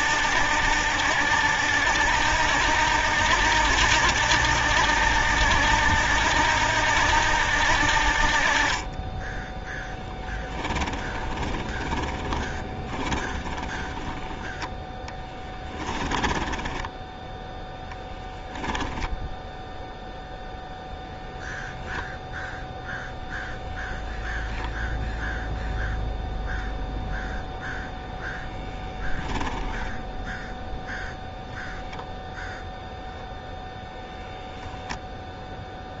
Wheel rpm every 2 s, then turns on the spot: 80, 80, 80, 80, 30, 20, 20, 10, 10, 0, 0, 0, 0, 0, 0, 0, 0, 10.
10-14 16-18